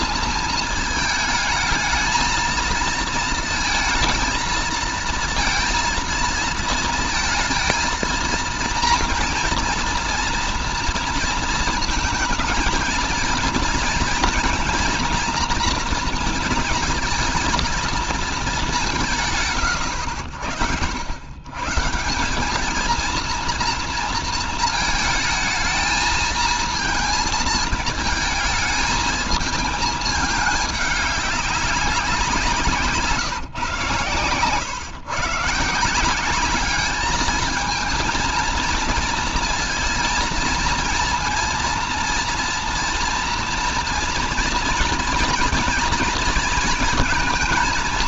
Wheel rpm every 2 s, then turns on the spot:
230, 230, 230, 230, 230, 230, 220, 230, 230, 200, 70, 210, 220, 220, 220, 210, 160, 110, 200, 230, 230, 230, 240, 230.
none